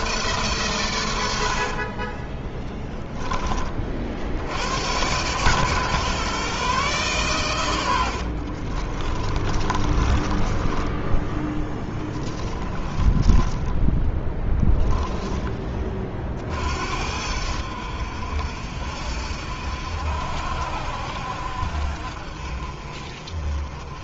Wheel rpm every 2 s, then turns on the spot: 130, 20, 80, 140, 50, 20, 20, 10, 50, 70, 70, 40.
2-4 8-14